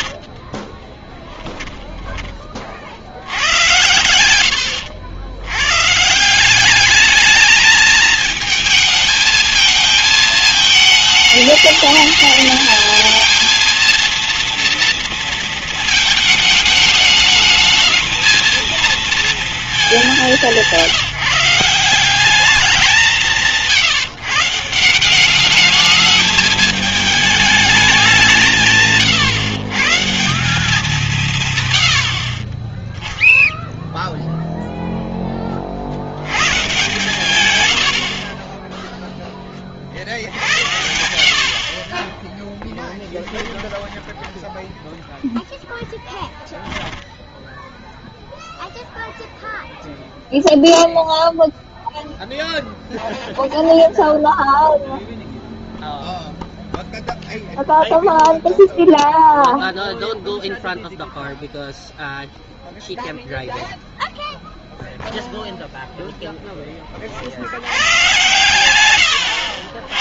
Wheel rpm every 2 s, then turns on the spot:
40, 30, 100, 180, 220, 220, 220, 230, 220, 220, 170, 180, 170, 220, 170, 180, 30, 0, 100, 30, 70, 10, 10, 10, 0, 0, 0, 0, 0, 0, 0, 0, 0, 10, 110.
0-2 4-6 38-40 42-48 68-70